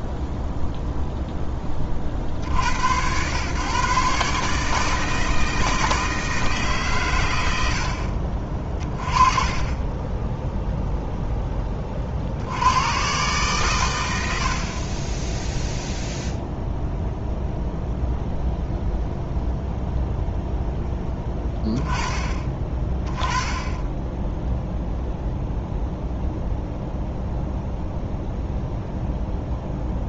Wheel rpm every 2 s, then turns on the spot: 0, 80, 150, 150, 40, 0, 90, 50, 0, 0, 0, 20, 0, 0, 0.
none